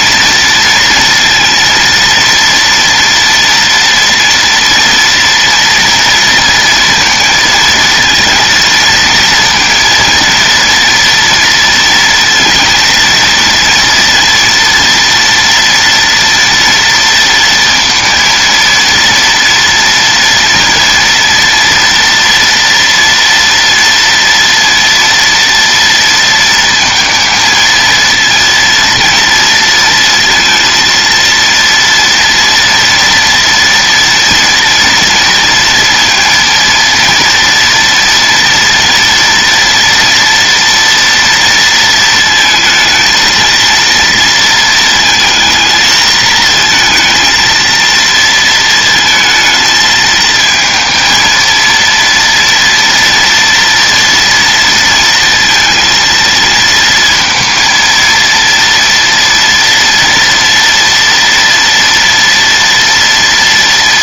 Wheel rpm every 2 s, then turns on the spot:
230, 230, 230, 230, 230, 230, 230, 230, 230, 230, 230, 230, 230, 230, 230, 230, 230, 230, 230, 240, 230, 220, 230, 230, 220, 220, 230, 230, 230, 230, 230, 230.
none